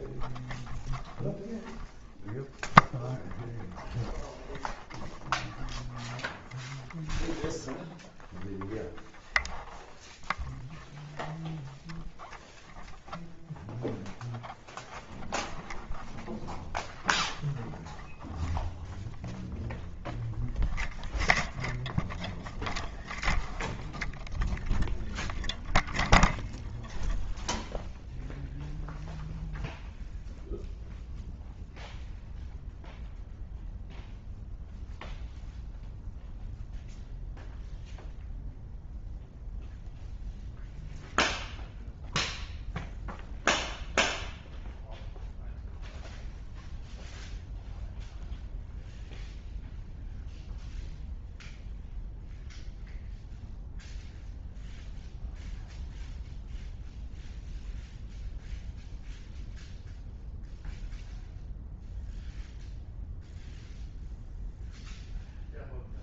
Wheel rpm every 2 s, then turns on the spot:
0, 0, 0, 0, 0, 0, 0, 0, 0, 0, 0, 0, 0, 0, 0, 0, 0, 0, 0, 0, 0, 0, 0, 0, 0, 0, 0, 0, 0, 0, 0, 0, 0.
none